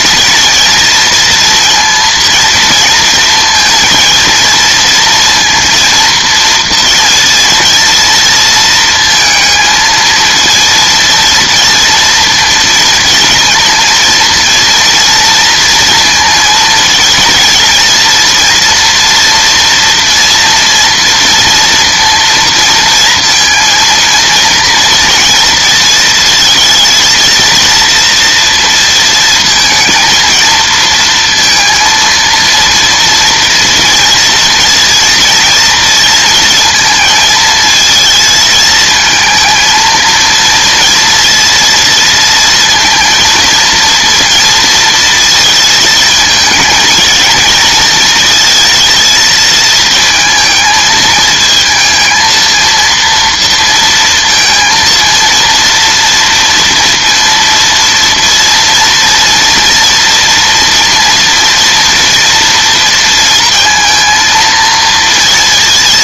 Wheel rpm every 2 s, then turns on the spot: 230, 230, 230, 230, 230, 230, 230, 230, 230, 240, 230, 230, 230, 230, 230, 230, 230, 230, 230, 220, 230, 230, 230, 220, 220, 220, 230, 230, 230, 230, 230, 230, 230.
none